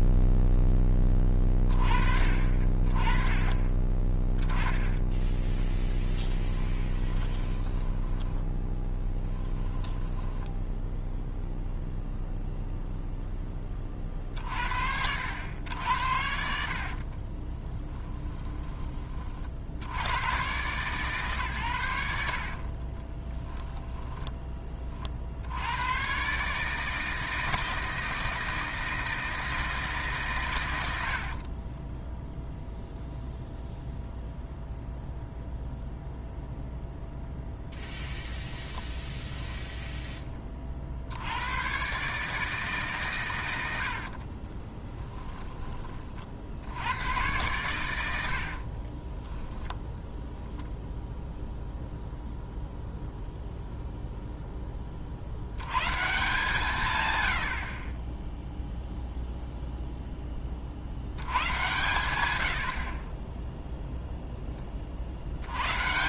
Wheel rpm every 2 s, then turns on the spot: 10, 40, 20, 10, 10, 0, 0, 60, 50, 30, 130, 30, 40, 160, 160, 90, 0, 0, 0, 0, 50, 140, 20, 80, 40, 0, 0, 40, 130, 0, 70, 50, 40.
6-10 16-18 22-24 30-32 44-46 48-50